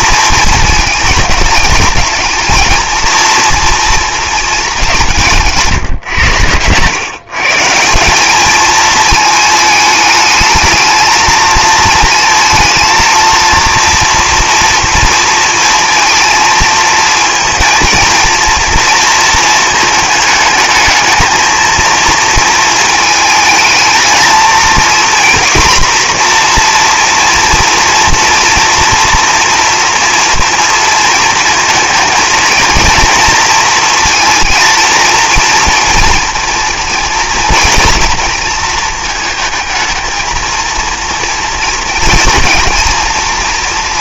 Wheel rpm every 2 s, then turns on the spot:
220, 220, 220, 110, 220, 220, 220, 230, 230, 230, 220, 230, 230, 240, 230, 230, 220, 230, 230, 230, 230, 230.
none